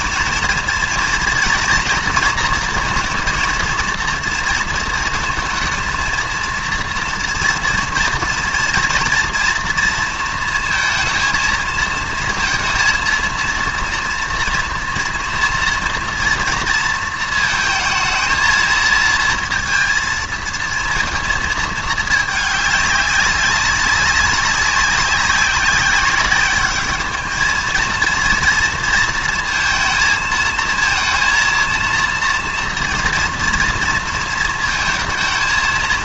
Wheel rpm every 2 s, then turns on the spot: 230, 230, 230, 230, 240, 230, 230, 240, 230, 220, 230, 210, 190, 210, 230, 230, 230, 230.
none